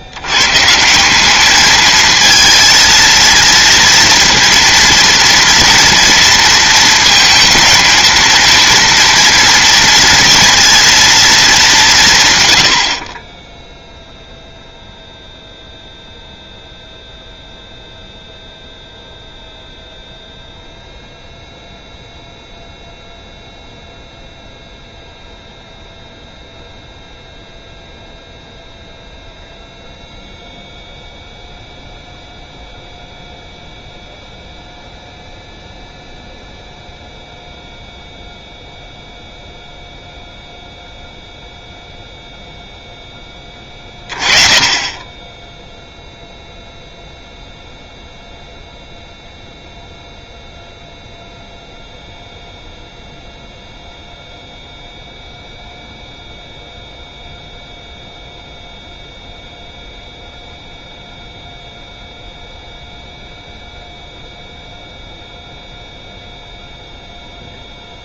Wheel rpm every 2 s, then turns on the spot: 160, 230, 230, 230, 230, 230, 70, 0, 0, 0, 0, 0, 0, 0, 0, 0, 0, 0, 0, 0, 0, 0, 20, 0, 0, 0, 0, 0, 0, 0, 0, 0, 0, 0.
none